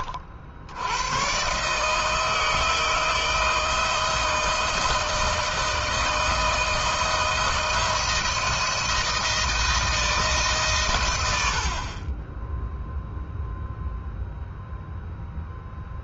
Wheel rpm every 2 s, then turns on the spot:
70, 160, 160, 160, 160, 140, 10, 0.
none